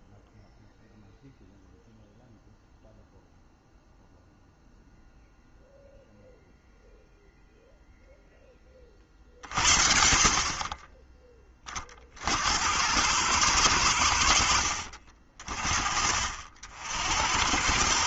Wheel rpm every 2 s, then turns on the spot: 0, 0, 0, 0, 30, 30, 80, 60, 60.
none